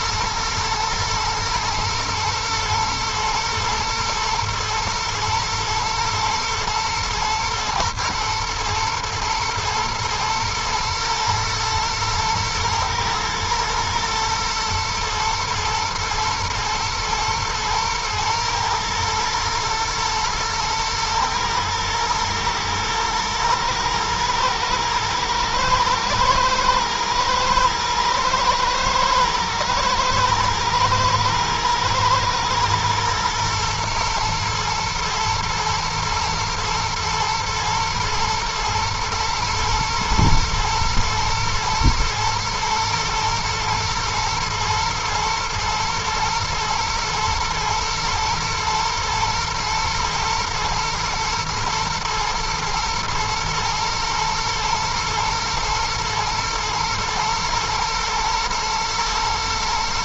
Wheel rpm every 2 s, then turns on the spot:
120, 110, 110, 110, 110, 110, 110, 120, 110, 120, 110, 110, 110, 120, 110, 110, 120, 110, 120, 120, 110, 120, 110, 110, 110, 110, 110, 120, 120, 110.
none